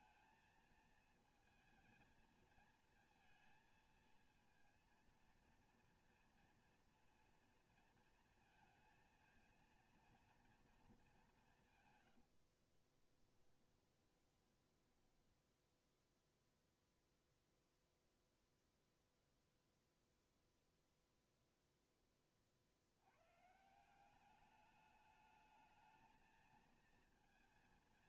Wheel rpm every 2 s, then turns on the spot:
220, 220, 230, 230, 230, 230, 50, 10, 0, 0, 0, 40, 200, 230.
12-16